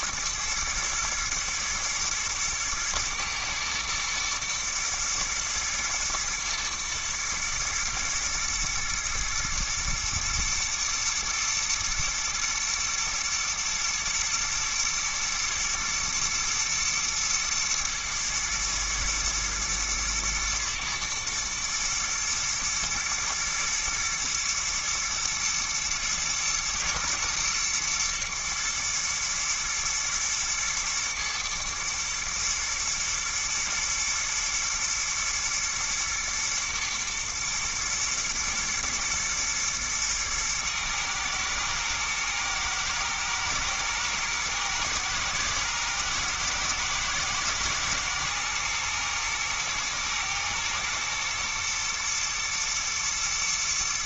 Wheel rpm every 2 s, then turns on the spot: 110, 120, 110, 120, 120, 110, 120, 110, 120, 110, 110, 120, 120, 120, 110, 120, 120, 120, 110, 120, 110, 110, 110, 110, 110, 120, 120.
none